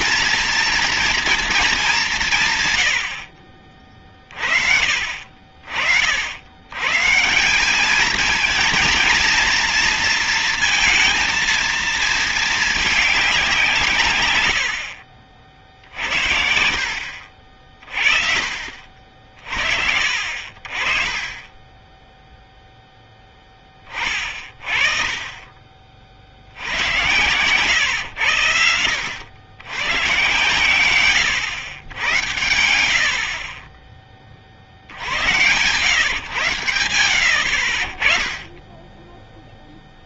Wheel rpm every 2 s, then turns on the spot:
230, 130, 50, 130, 230, 230, 210, 70, 60, 40, 40, 0, 30, 100, 100, 130, 80, 50, 90, 10.
14-16